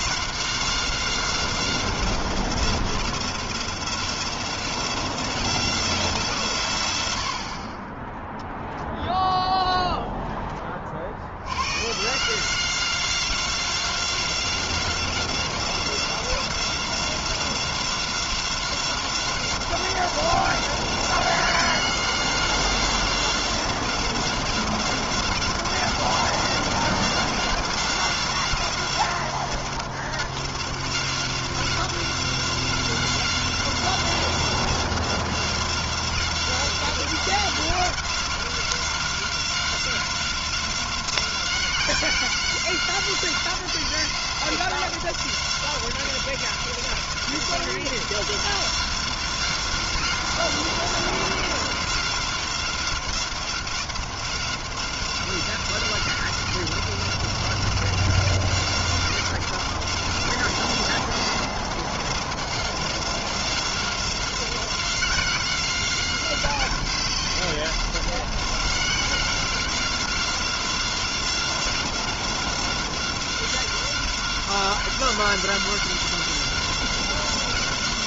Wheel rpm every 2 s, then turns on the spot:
190, 180, 180, 60, 0, 80, 180, 180, 180, 180, 180, 180, 180, 180, 180, 180, 180, 180, 180, 180, 180, 180, 180, 180, 180, 180, 180, 190, 180, 180, 180, 190, 180, 180, 180, 180, 180, 180, 180.
none